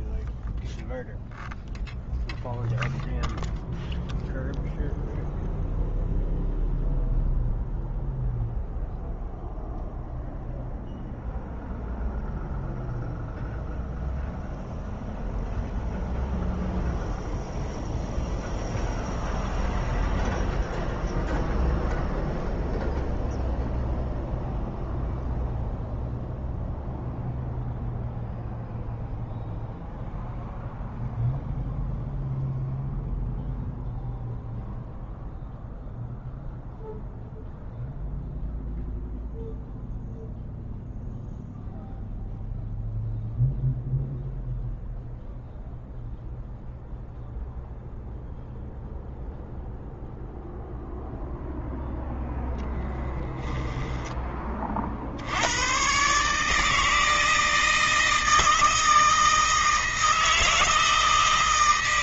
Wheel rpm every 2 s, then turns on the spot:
0, 0, 0, 0, 0, 0, 0, 0, 0, 0, 0, 0, 0, 0, 0, 0, 0, 0, 0, 0, 0, 0, 0, 0, 0, 0, 10, 40, 160, 160, 160.
52-54